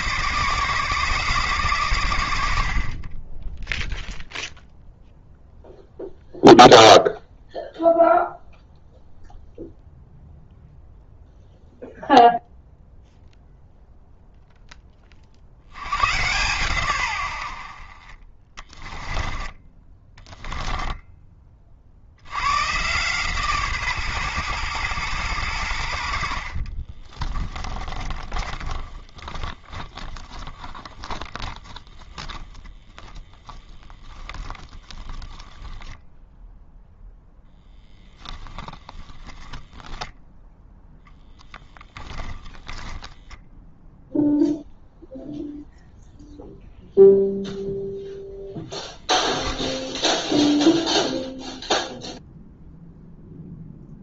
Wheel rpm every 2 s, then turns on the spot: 140, 40, 0, 0, 0, 0, 0, 20, 120, 20, 10, 130, 120, 30, 20, 10, 20, 20, 0, 10, 0, 0, 0, 0, 0, 0, 0.
18-22 26-32 34-36 38-40